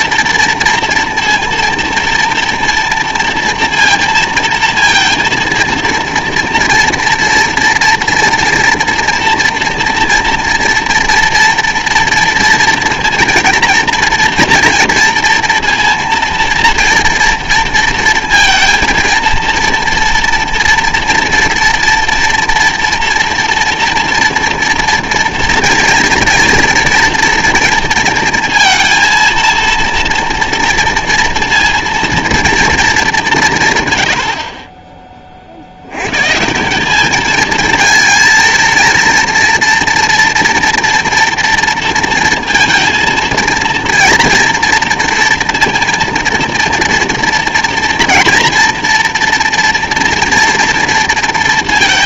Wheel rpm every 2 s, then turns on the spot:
230, 230, 230, 230, 230, 230, 230, 230, 230, 230, 230, 230, 230, 230, 230, 230, 230, 60, 150, 230, 230, 230, 230, 230, 230, 230.
none